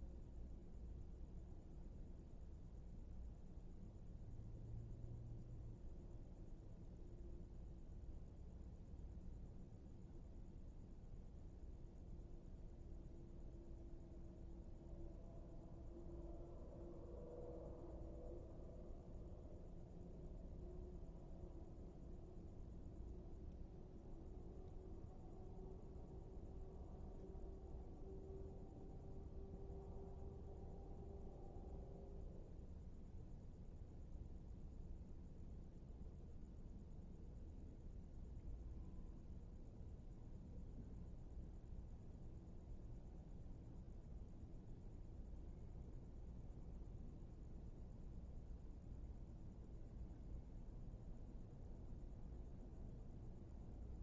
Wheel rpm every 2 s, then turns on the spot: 0, 0, 0, 0, 0, 0, 0, 0, 0, 0, 0, 0, 0, 0, 0, 0, 0, 0, 0, 0, 0, 0, 0, 0, 0, 0, 0.
none